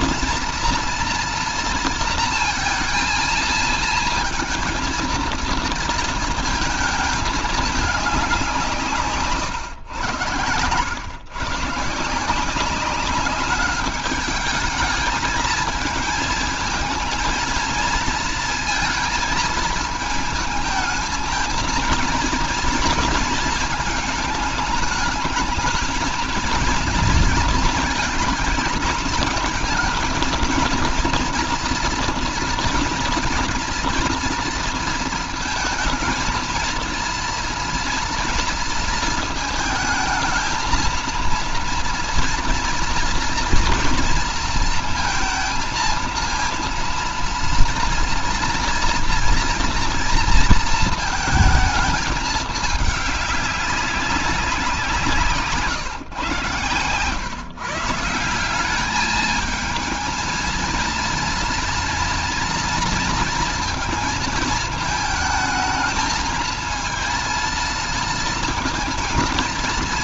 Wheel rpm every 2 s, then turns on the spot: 230, 230, 230, 220, 170, 100, 190, 210, 220, 230, 220, 230, 210, 230, 220, 230, 230, 230, 230, 220, 230, 230, 230, 230, 230, 220, 200, 180, 130, 200, 230, 230, 220, 230, 230.
none